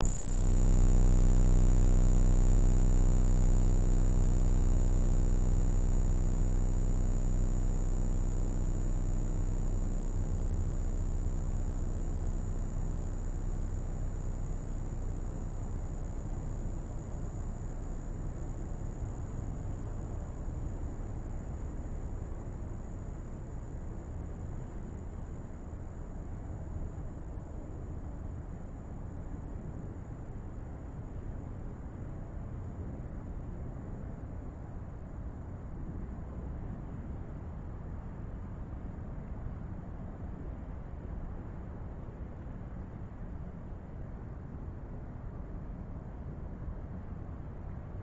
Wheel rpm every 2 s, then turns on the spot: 0, 0, 0, 0, 0, 0, 0, 0, 0, 0, 0, 0, 0, 0, 0, 0, 0, 0, 0, 0, 0, 0, 0, 0.
none